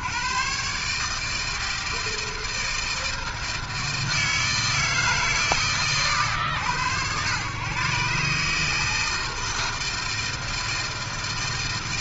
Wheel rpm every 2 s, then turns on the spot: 70, 160, 160, 100, 140, 160.
none